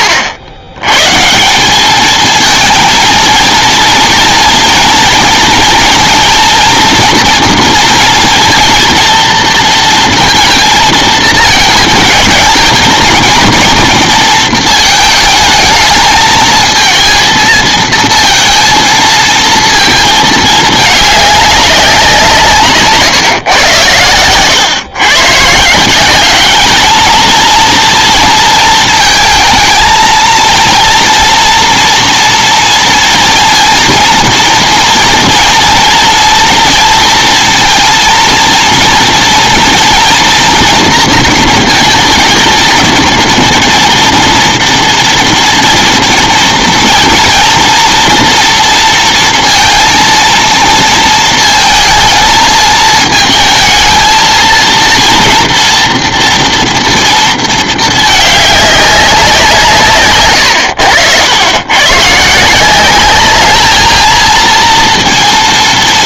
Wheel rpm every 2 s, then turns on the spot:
100, 230, 230, 230, 230, 220, 230, 220, 230, 220, 210, 140, 130, 220, 220, 240, 230, 220, 230, 230, 230, 230, 240, 230, 230, 230, 220, 230, 230, 190, 90, 190, 230.
none